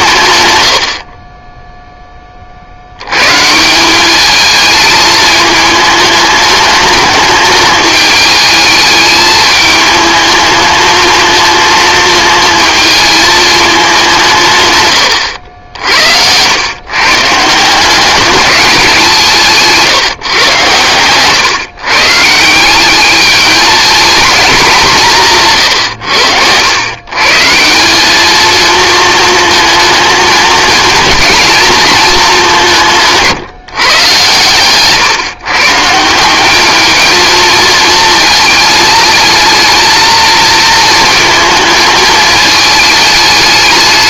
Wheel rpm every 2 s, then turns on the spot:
70, 80, 220, 210, 210, 220, 220, 110, 140, 190, 120, 190, 180, 110, 220, 230, 170, 130, 220, 220, 230, 220.
14-16